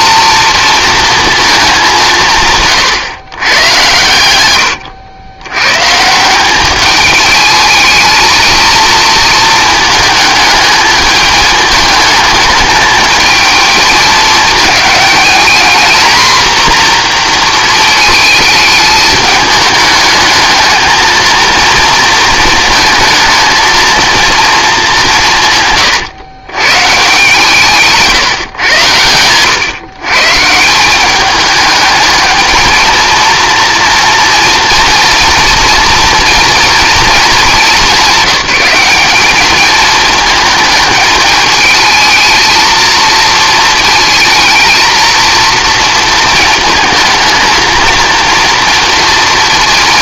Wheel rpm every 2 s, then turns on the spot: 230, 150, 100, 200, 230, 220, 220, 210, 240, 210, 220, 220, 210, 120, 130, 160, 220, 240, 230, 190, 220, 220, 230, 220, 230.
4-6